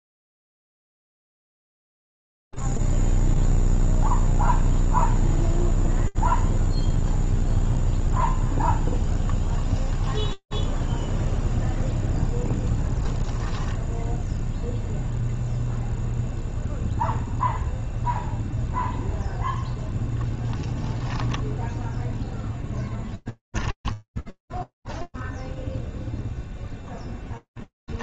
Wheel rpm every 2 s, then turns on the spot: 0, 0, 0, 0, 0, 0, 10, 0, 0, 0, 0, 10, 10, 0.
12-14 22-26